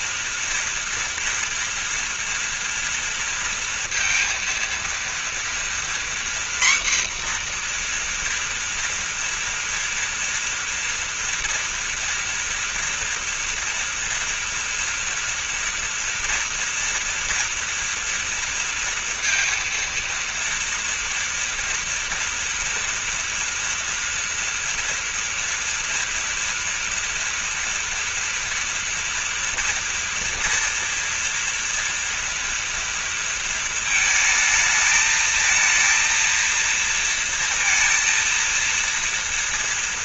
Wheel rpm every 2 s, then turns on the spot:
230, 230, 230, 240, 240, 230, 230, 230, 230, 230, 230, 240, 240, 230, 240, 230, 230, 220, 230, 230.
none